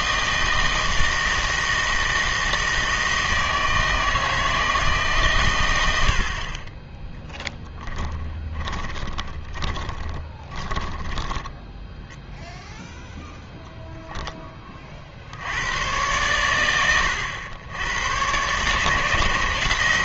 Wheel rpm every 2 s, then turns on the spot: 160, 160, 150, 10, 20, 10, 0, 40, 100, 140.
8-12